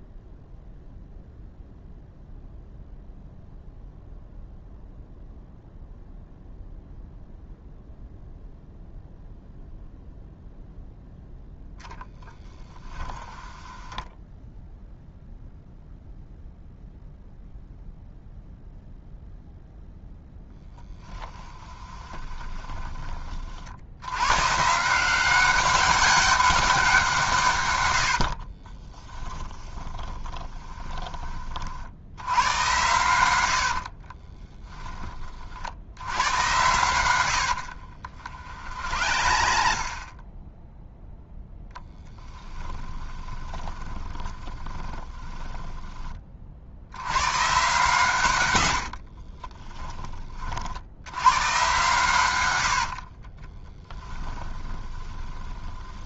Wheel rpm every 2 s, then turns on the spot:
0, 0, 0, 0, 0, 0, 10, 0, 0, 0, 10, 20, 160, 190, 30, 20, 100, 10, 90, 60, 0, 20, 20, 70, 90, 70, 70, 20.
12-14 20-22 28-32 38-40 42-46 48-50 52-56